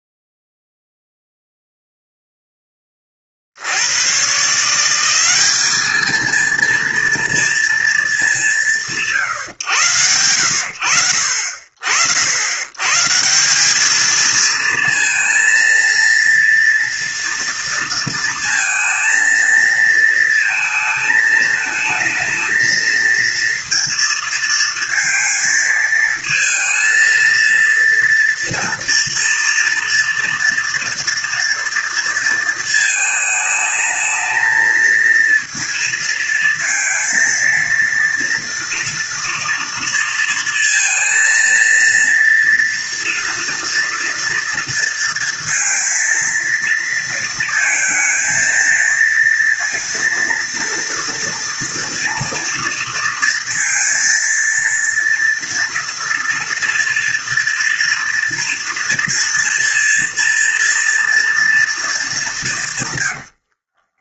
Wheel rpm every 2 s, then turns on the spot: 0, 10, 170, 230, 160, 60, 110, 230, 230, 230, 220, 220, 230, 230, 230, 230, 220, 220, 220, 230, 230, 230, 230, 230, 230, 230, 230, 230, 230, 230, 230, 140.
62-64